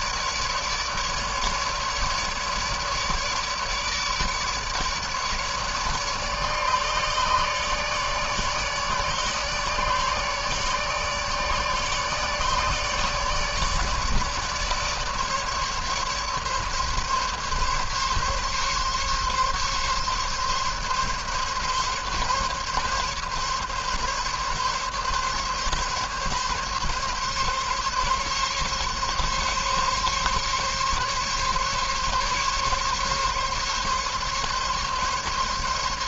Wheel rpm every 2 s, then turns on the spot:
150, 150, 150, 150, 150, 150, 150, 150, 140, 140, 140, 140, 140, 140, 140, 140, 140, 140.
none